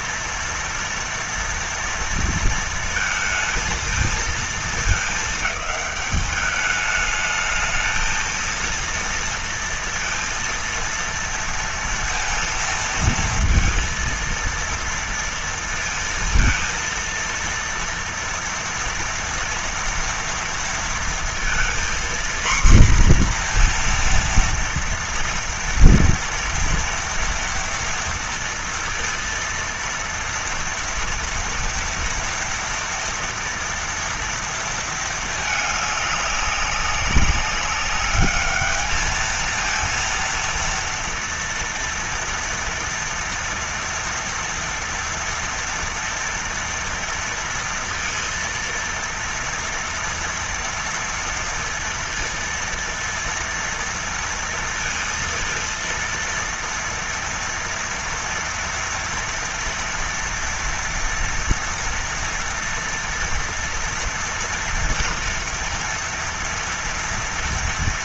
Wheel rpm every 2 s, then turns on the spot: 230, 230, 230, 210, 220, 230, 230, 230, 230, 230, 230, 240, 240, 240, 230, 230, 230, 230, 210, 200, 230, 230, 230, 230, 230, 230, 230, 230, 230, 230, 230, 230, 230, 230.
none